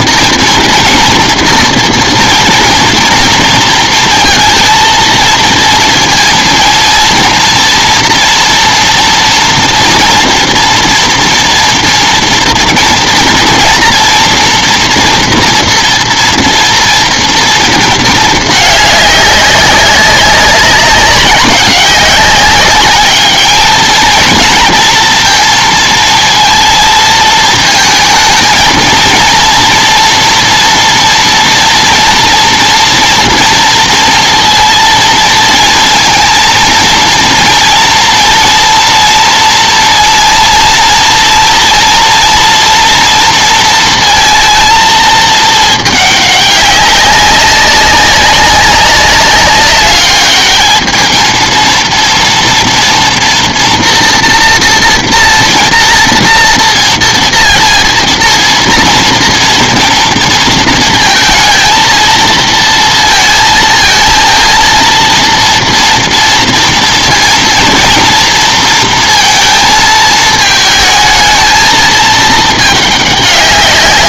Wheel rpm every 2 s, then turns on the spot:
240, 240, 230, 230, 240, 230, 240, 240, 230, 210, 200, 200, 220, 220, 230, 230, 230, 230, 230, 230, 230, 230, 220, 200, 190, 210, 230, 230, 230, 230, 230, 230, 230, 230, 230, 220, 210.
none